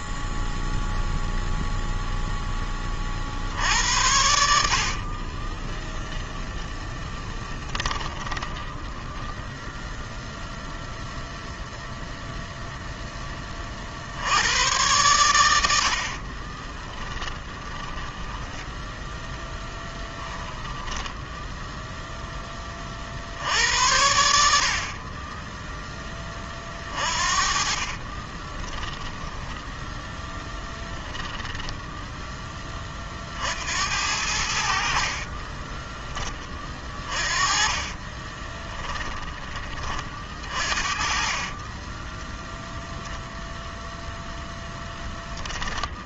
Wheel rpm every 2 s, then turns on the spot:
0, 0, 80, 10, 10, 0, 10, 110, 20, 0, 10, 40, 40, 40, 10, 10, 30, 50, 30, 10, 40, 0, 10.
4-10 16-18 20-22 26-32 36-40